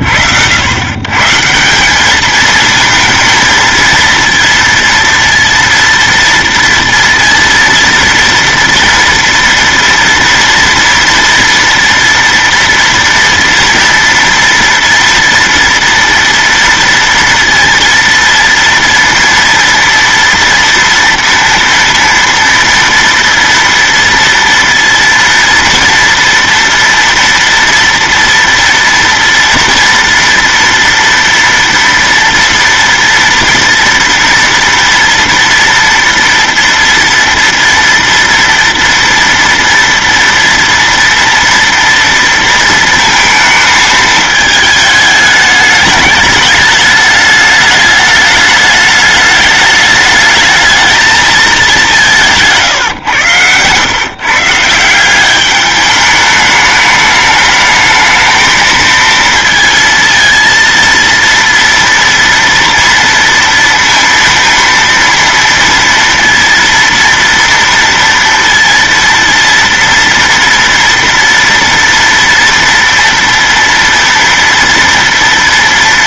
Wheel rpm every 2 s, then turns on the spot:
60, 220, 230, 230, 230, 230, 230, 230, 230, 230, 230, 230, 230, 230, 230, 230, 230, 230, 230, 230, 230, 230, 220, 210, 210, 220, 150, 160, 210, 220, 230, 230, 230, 230, 230, 230, 230, 230.
52-54